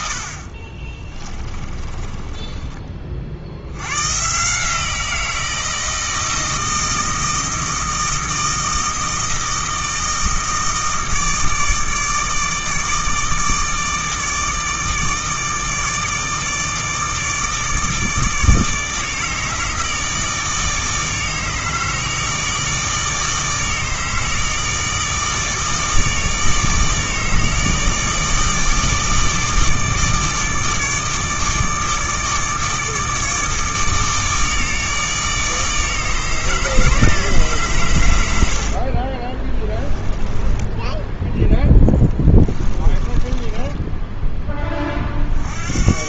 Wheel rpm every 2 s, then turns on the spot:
40, 30, 150, 160, 160, 160, 160, 160, 160, 150, 160, 160, 150, 160, 160, 150, 160, 150, 150, 70, 10, 20, 20.
0-4 38-44